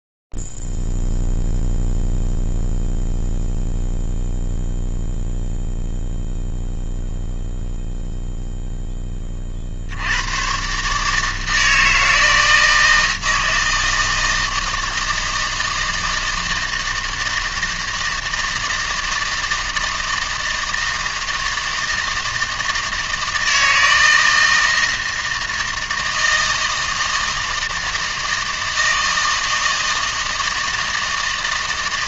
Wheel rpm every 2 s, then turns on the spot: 0, 0, 0, 0, 0, 80, 160, 160, 160, 160, 160, 160, 160, 160, 160, 160.
none